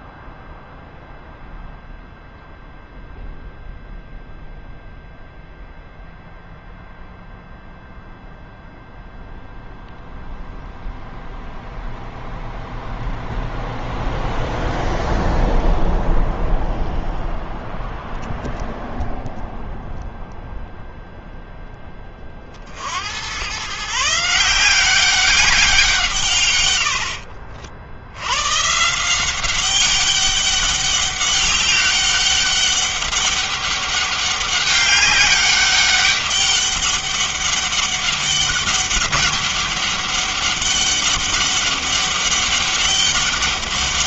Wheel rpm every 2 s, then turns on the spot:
0, 0, 0, 0, 0, 0, 0, 0, 0, 0, 0, 40, 170, 130, 100, 200, 200, 200, 200, 200, 200, 200.
none